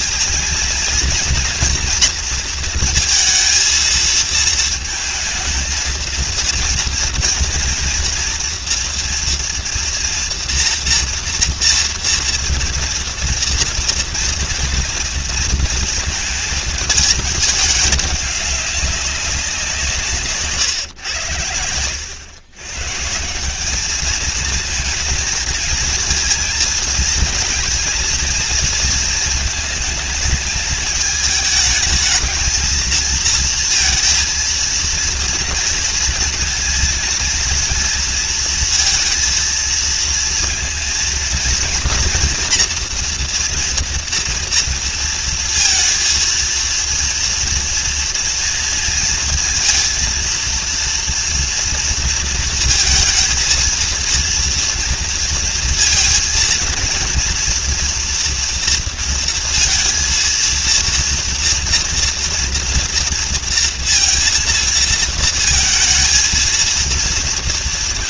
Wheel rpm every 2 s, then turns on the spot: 230, 230, 220, 230, 230, 230, 230, 230, 220, 200, 120, 130, 230, 230, 230, 220, 230, 230, 230, 230, 230, 240, 230, 230, 230, 230, 220, 230, 230, 230, 230, 230, 230, 230.
none